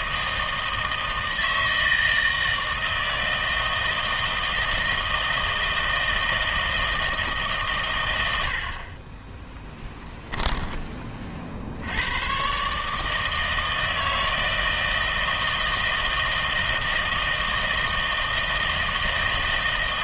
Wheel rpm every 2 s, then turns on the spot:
160, 160, 160, 160, 30, 20, 150, 160, 160, 160.
none